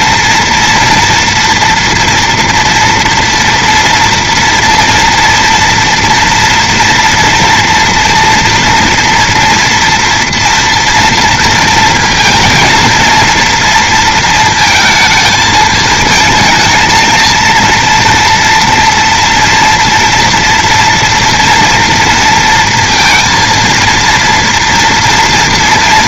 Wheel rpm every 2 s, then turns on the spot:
240, 230, 230, 230, 230, 230, 230, 220, 220, 230, 230, 230, 230.
none